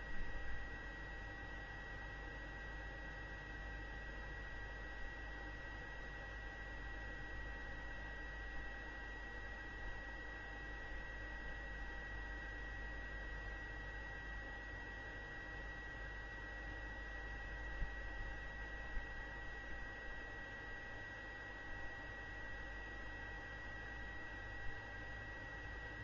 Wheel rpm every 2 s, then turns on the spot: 0, 0, 0, 0, 0, 0, 0, 0, 0, 0, 0, 0, 0.
none